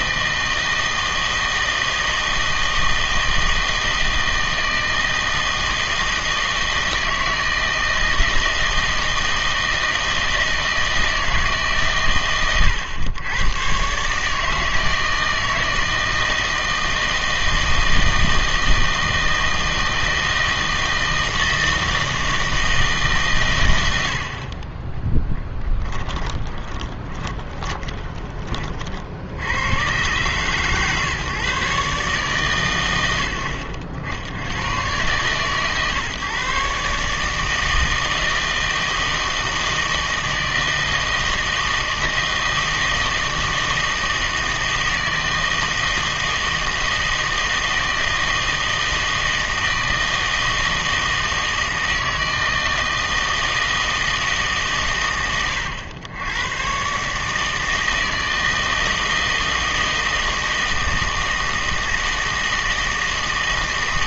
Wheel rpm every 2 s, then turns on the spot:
160, 160, 160, 160, 160, 160, 120, 160, 160, 160, 160, 160, 20, 20, 50, 130, 120, 110, 140, 160, 160, 160, 160, 160, 160, 160, 160, 140, 130, 160, 160, 160.
26-28